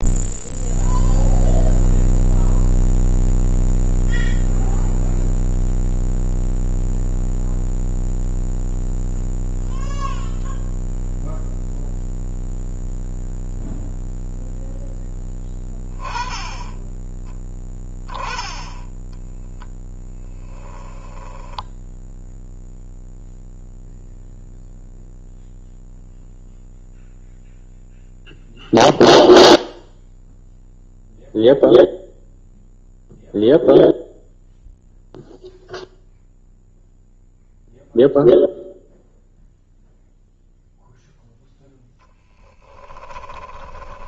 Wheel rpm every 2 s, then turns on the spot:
0, 0, 0, 0, 0, 0, 0, 0, 20, 10, 10, 0, 0, 0, 0, 0, 0, 0, 0, 0, 0, 10.
20-22 42-44